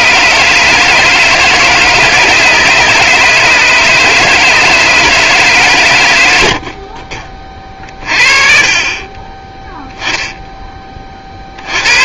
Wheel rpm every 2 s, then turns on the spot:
160, 160, 160, 60, 30, 10.
none